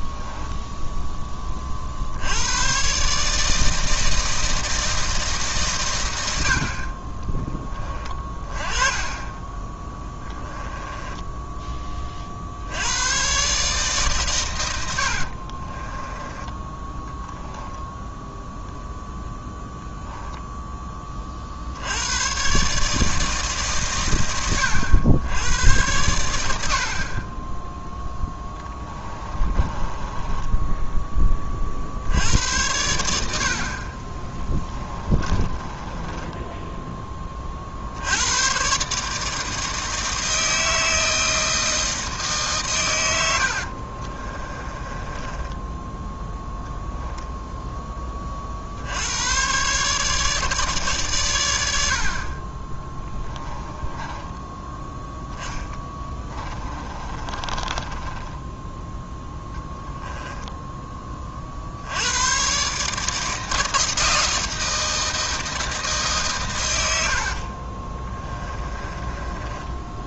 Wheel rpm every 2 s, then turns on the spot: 10, 110, 160, 50, 20, 10, 70, 100, 10, 0, 10, 140, 90, 80, 10, 10, 90, 20, 10, 130, 160, 130, 20, 0, 60, 150, 30, 10, 20, 10, 10, 140, 160, 100, 20.
0-2 8-12 28-32 34-36 44-46 54-58 68-70